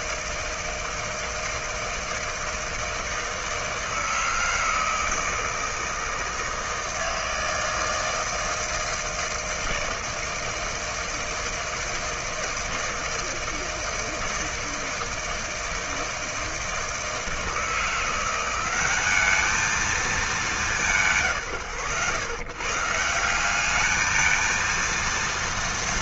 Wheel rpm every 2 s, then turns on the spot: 160, 160, 160, 160, 160, 160, 160, 160, 160, 190, 190, 150, 230.
none